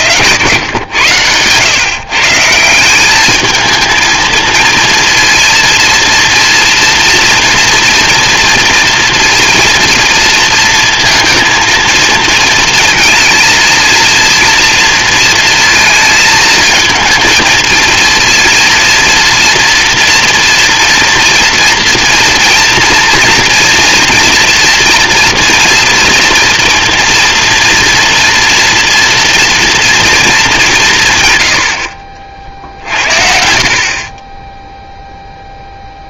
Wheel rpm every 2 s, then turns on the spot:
150, 180, 230, 230, 230, 230, 230, 230, 220, 230, 230, 230, 240, 230, 230, 170, 60, 10.
none